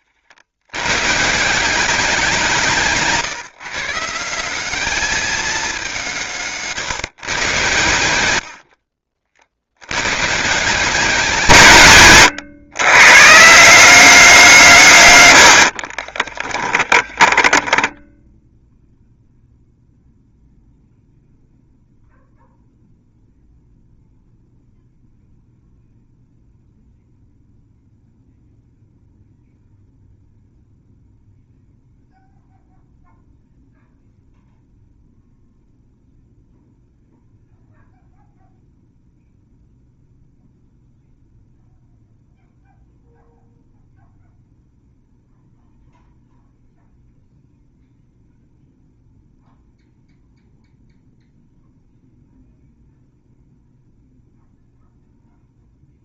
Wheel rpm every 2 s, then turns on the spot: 90, 170, 210, 150, 60, 170, 120, 160, 10, 0, 0, 0, 0, 0, 0, 0, 0, 0, 0, 0, 0, 0, 0, 0, 0, 0, 0, 0.
16-18